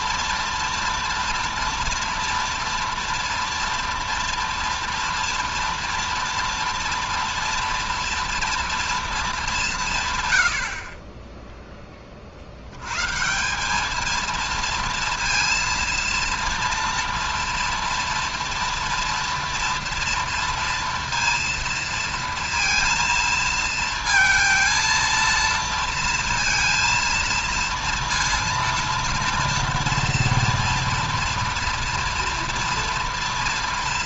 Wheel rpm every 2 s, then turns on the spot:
230, 230, 230, 230, 230, 90, 70, 230, 230, 230, 230, 230, 230, 230, 230, 230, 230.
none